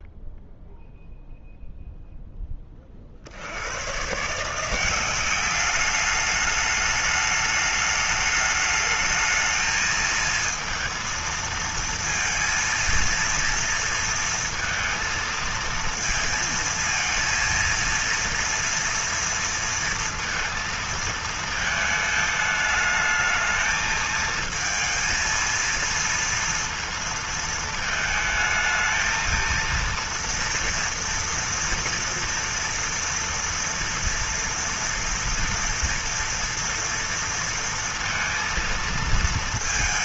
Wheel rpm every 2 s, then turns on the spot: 0, 0, 110, 200, 210, 220, 230, 230, 230, 230, 230, 220, 220, 230, 220, 230, 230, 230, 230, 230.
none